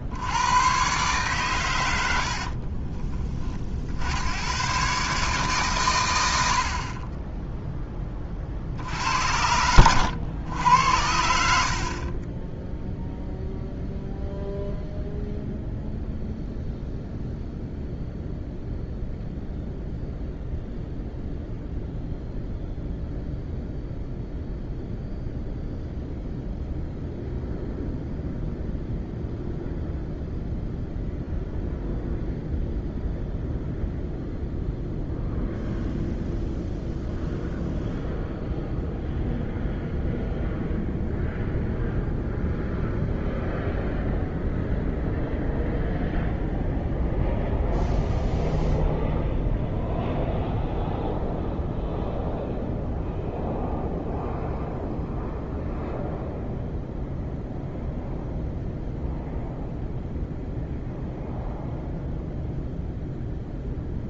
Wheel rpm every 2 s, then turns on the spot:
120, 40, 140, 40, 70, 90, 0, 0, 0, 0, 0, 0, 0, 0, 0, 0, 0, 0, 0, 0, 0, 0, 0, 0, 0, 0, 0, 0, 0, 0, 0, 0.
2-4